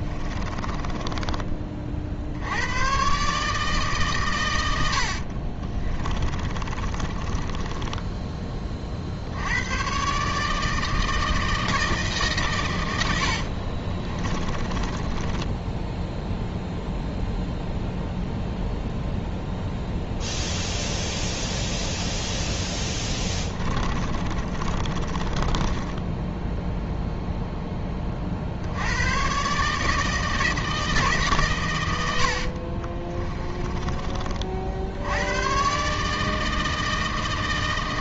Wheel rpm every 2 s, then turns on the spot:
20, 100, 100, 30, 30, 160, 100, 20, 0, 0, 0, 0, 30, 0, 90, 160, 40, 70, 160.
0-2 4-8 14-16 24-26 32-34